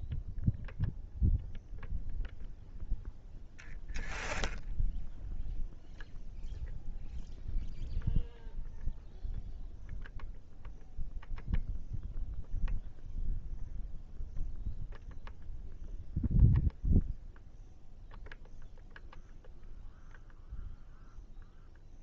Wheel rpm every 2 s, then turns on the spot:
0, 10, 10, 0, 0, 0, 0, 0, 0, 0, 0.
none